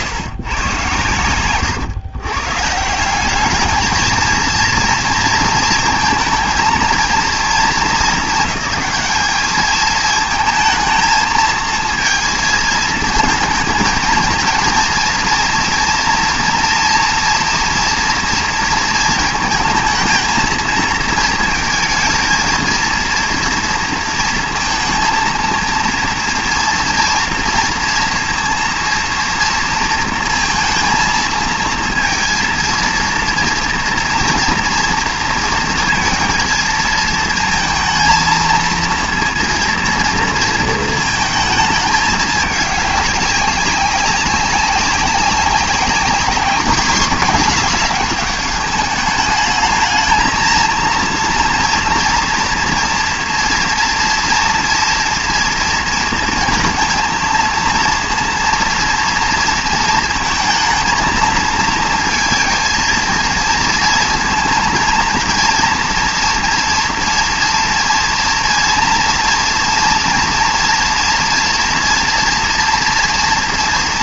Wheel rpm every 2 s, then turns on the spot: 130, 130, 230, 220, 210, 220, 220, 230, 230, 230, 220, 230, 230, 230, 230, 230, 230, 230, 220, 230, 230, 210, 190, 210, 210, 230, 240, 230, 230, 230, 230, 230, 230, 240, 230, 230, 230.
none